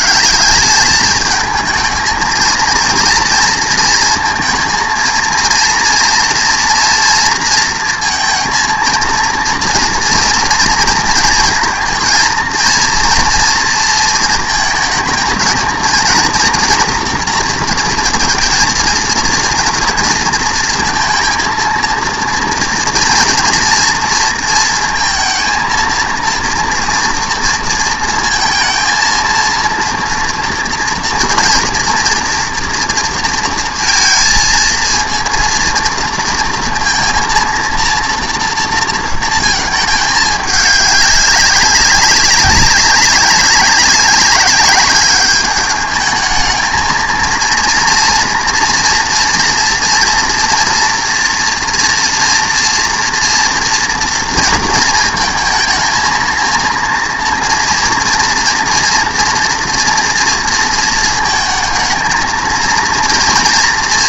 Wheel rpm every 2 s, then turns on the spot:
210, 230, 230, 230, 230, 230, 230, 230, 240, 220, 230, 230, 230, 230, 230, 230, 230, 230, 230, 230, 200, 200, 200, 230, 230, 230, 230, 230, 230, 230, 220, 230.
none